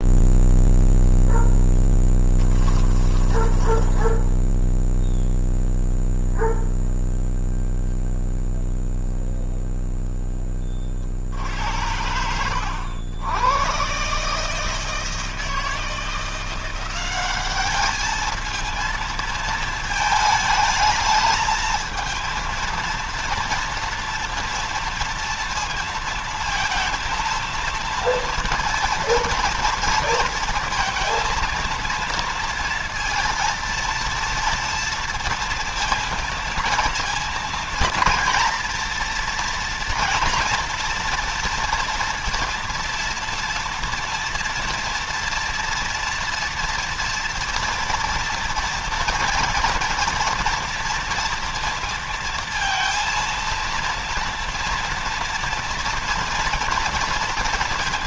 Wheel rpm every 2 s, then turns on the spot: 0, 10, 0, 0, 0, 20, 90, 140, 170, 220, 220, 230, 230, 230, 230, 230, 230, 230, 230, 230, 230, 230, 230, 230, 230, 230, 230, 230, 230.
2-4